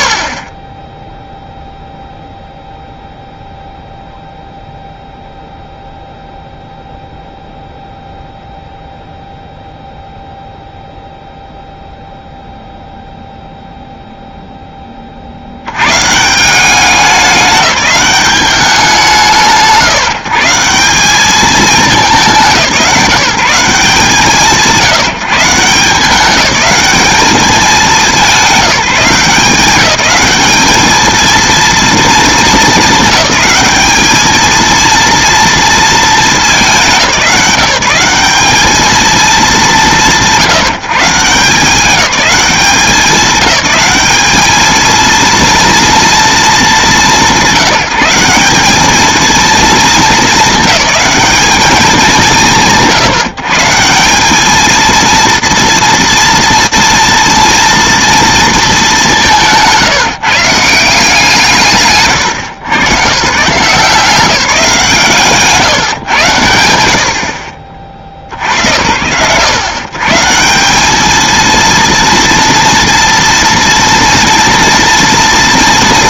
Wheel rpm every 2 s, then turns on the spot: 40, 0, 0, 0, 0, 0, 0, 10, 190, 180, 170, 150, 170, 210, 190, 210, 210, 230, 190, 210, 140, 190, 220, 200, 210, 220, 130, 220, 230, 200, 170, 140, 160, 50, 70, 170, 230, 230.
none